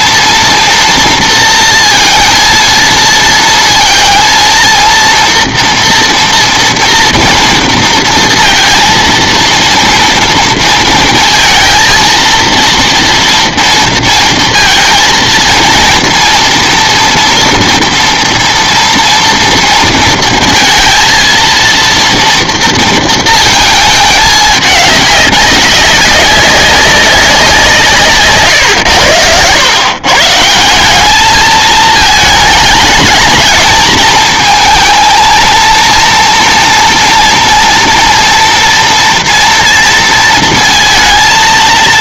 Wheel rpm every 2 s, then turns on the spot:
230, 230, 230, 230, 230, 230, 230, 230, 230, 230, 220, 230, 210, 200, 130, 170, 210, 220, 230, 230, 230.
none